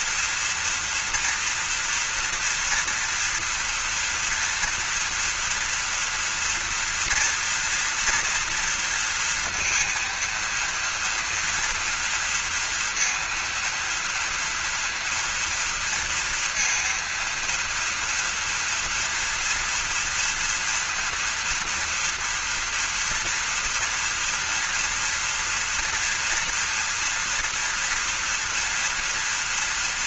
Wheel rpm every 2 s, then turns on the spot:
230, 230, 230, 240, 230, 230, 230, 230, 230, 230, 230, 230, 230, 230, 230.
none